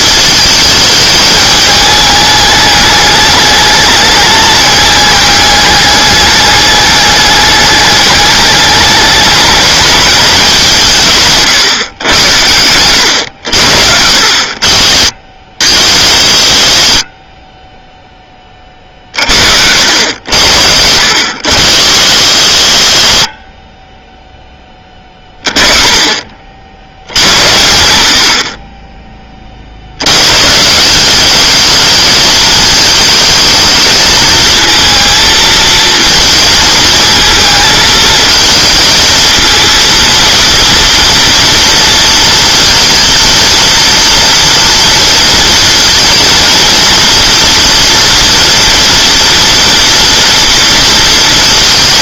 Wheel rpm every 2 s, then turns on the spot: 220, 210, 210, 210, 210, 180, 90, 50, 50, 30, 70, 70, 20, 70, 20, 160, 220, 230, 220, 220, 230, 230, 230, 230, 230, 230.
12-14